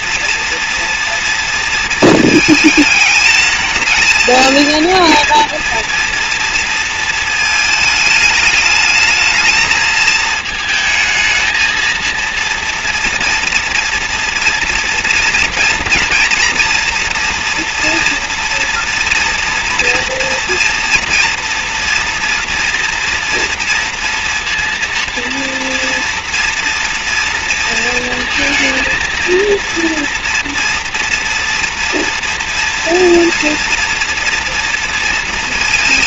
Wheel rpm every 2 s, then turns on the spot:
230, 220, 220, 230, 220, 220, 230, 240, 230, 230, 230, 240, 230, 230, 230, 240, 230, 230.
none